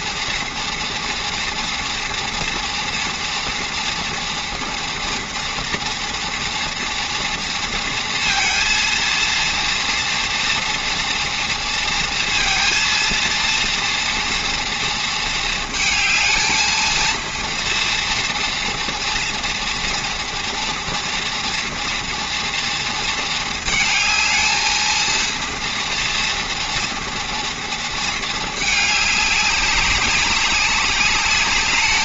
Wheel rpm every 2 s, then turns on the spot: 230, 230, 230, 230, 230, 230, 230, 240, 220, 230, 230, 230, 230, 230, 210, 200.
none